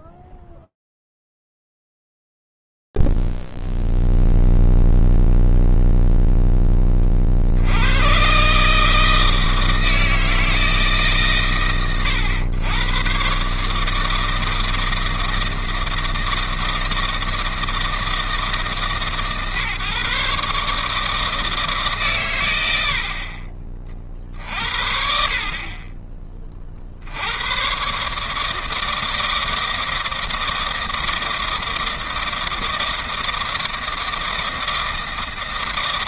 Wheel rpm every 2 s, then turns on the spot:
0, 0, 0, 0, 100, 160, 130, 160, 160, 160, 140, 130, 50, 30, 150, 160, 160, 160.
none